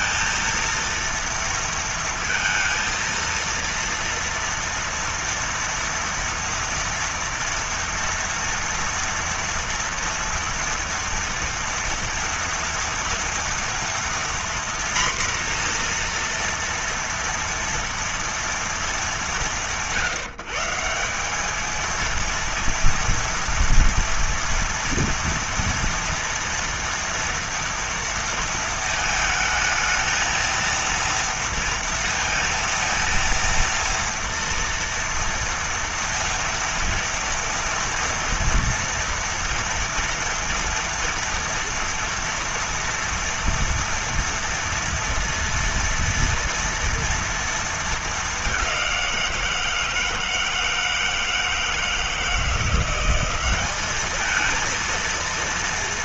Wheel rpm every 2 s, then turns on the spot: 230, 230, 230, 230, 230, 230, 230, 240, 230, 190, 180, 230, 230, 230, 220, 230, 230, 230, 230, 230, 230, 230, 230, 230, 180, 160, 180, 230.
none